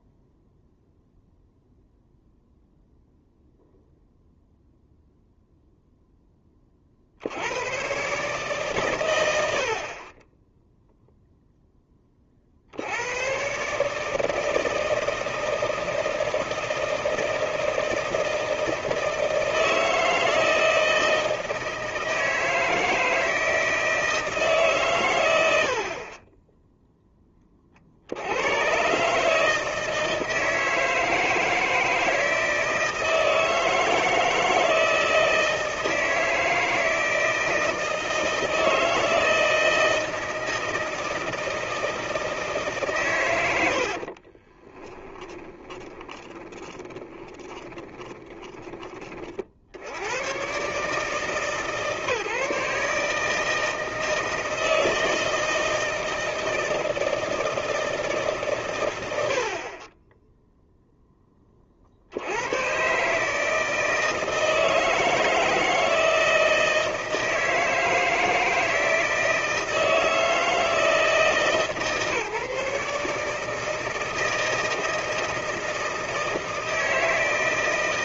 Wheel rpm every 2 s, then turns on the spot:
0, 0, 0, 30, 140, 0, 60, 160, 160, 160, 160, 160, 150, 10, 130, 160, 160, 160, 160, 160, 160, 150, 20, 20, 10, 130, 150, 160, 160, 130, 0, 120, 160, 160, 170, 160, 150, 160, 160.
44-48